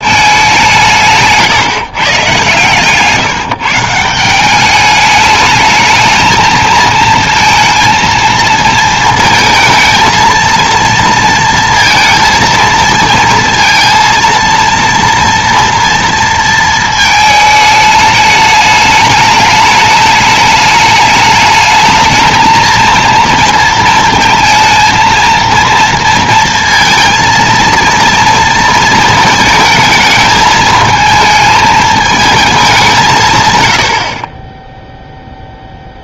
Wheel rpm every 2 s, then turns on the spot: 190, 130, 190, 220, 230, 230, 230, 230, 230, 210, 210, 220, 230, 230, 230, 220, 220, 20.
none